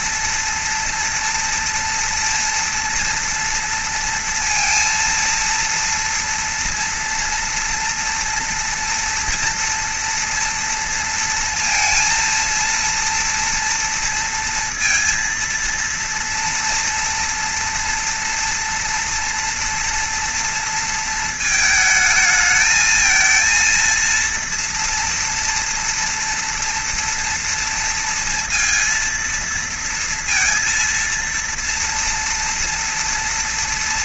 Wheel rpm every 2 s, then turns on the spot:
230, 230, 230, 230, 240, 230, 230, 230, 230, 230, 220, 220, 230, 230, 230, 230, 240.
none